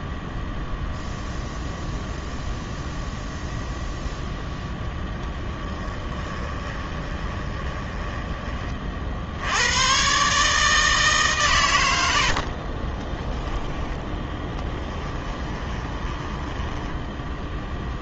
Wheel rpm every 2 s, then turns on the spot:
0, 0, 0, 20, 30, 150, 40, 10, 10.
6-8 12-18